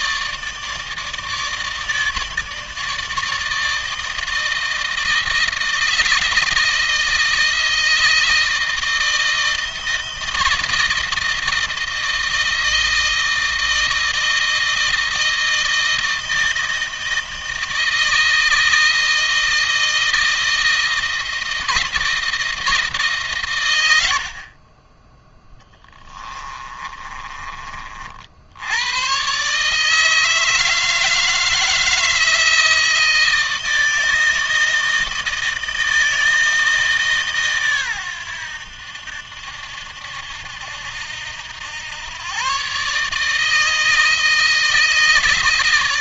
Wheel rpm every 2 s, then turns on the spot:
150, 160, 160, 160, 160, 160, 160, 160, 160, 160, 160, 150, 30, 30, 100, 160, 160, 160, 150, 80, 80, 140, 160.
24-28